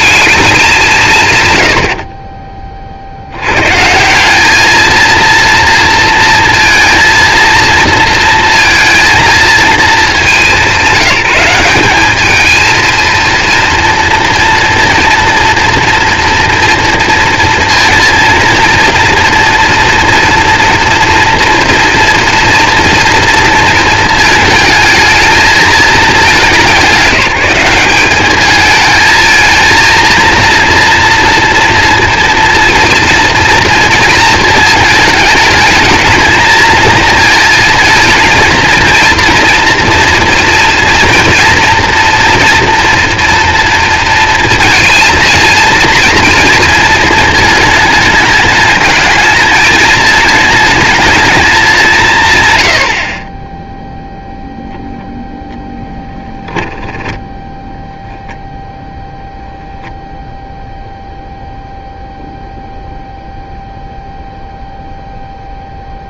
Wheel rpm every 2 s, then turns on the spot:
190, 40, 220, 230, 230, 190, 220, 230, 230, 230, 240, 230, 220, 180, 210, 230, 230, 220, 220, 230, 230, 240, 230, 230, 210, 220, 100, 0, 10, 0, 0, 0, 0.
none